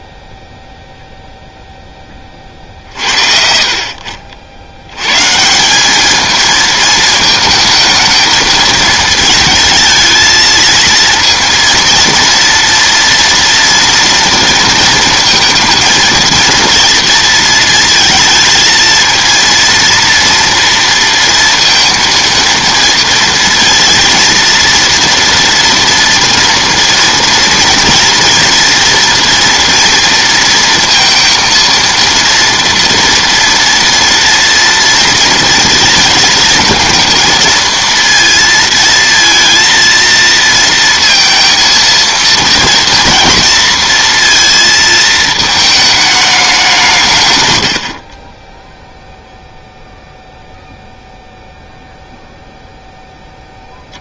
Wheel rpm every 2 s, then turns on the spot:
0, 50, 70, 220, 220, 230, 230, 230, 230, 220, 230, 230, 230, 230, 230, 230, 230, 230, 230, 230, 230, 240, 230, 190, 10, 0, 0.
none